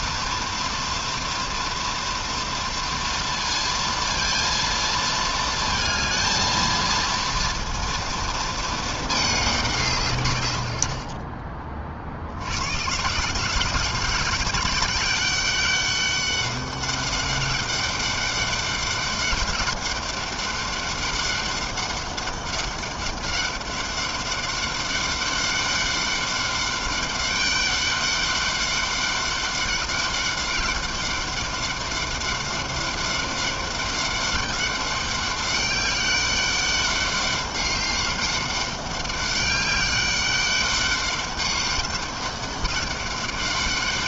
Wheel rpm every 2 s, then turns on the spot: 230, 230, 220, 230, 200, 30, 170, 200, 200, 200, 200, 200, 200, 200, 200, 200, 200, 200, 200, 200, 200, 200.
none